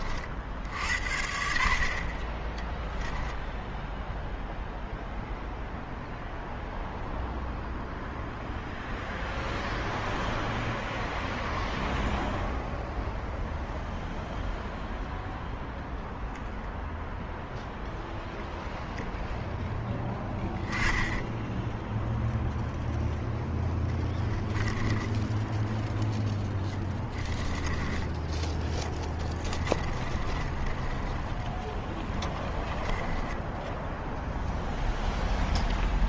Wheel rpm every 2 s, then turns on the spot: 60, 10, 0, 0, 0, 0, 0, 0, 0, 0, 10, 0, 20, 10, 20, 20, 10, 0.
20-22 24-34